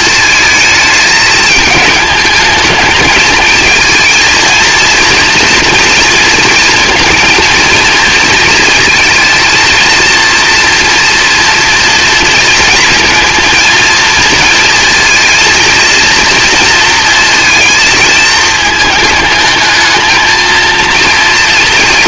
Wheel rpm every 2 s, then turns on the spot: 220, 220, 230, 230, 230, 230, 230, 230, 230, 220, 230.
none